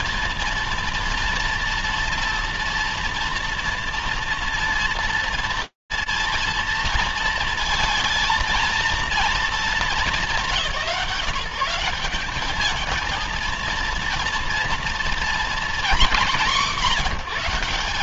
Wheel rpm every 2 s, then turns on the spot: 230, 230, 230, 230, 230, 170, 220, 230, 170.
none